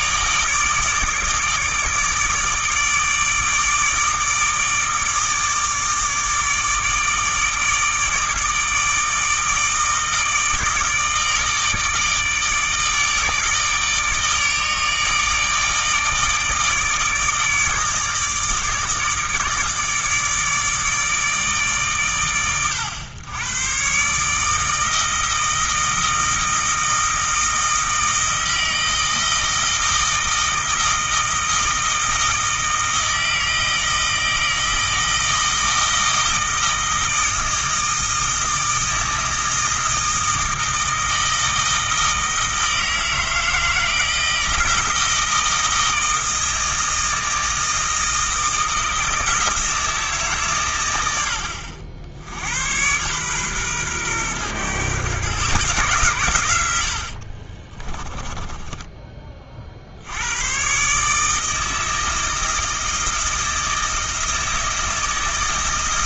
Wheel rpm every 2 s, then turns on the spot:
160, 160, 150, 150, 160, 160, 150, 150, 150, 160, 150, 110, 160, 160, 160, 160, 160, 160, 160, 160, 160, 160, 160, 160, 160, 110, 100, 120, 90, 20, 130, 160, 160.
58-60